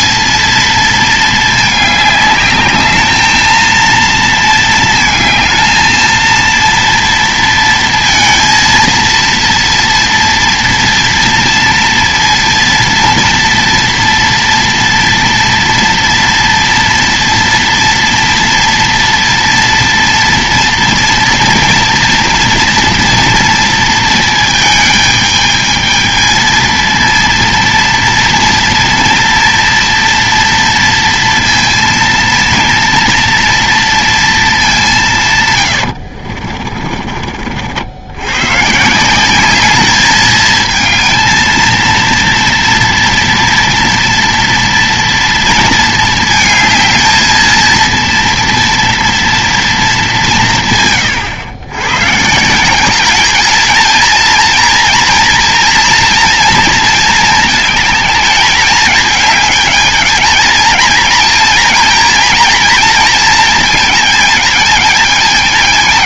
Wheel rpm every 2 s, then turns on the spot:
220, 210, 220, 230, 230, 230, 230, 230, 230, 240, 230, 240, 220, 220, 230, 230, 230, 220, 40, 130, 220, 230, 230, 220, 230, 150, 170, 230, 230, 210, 220, 230, 220.
36-38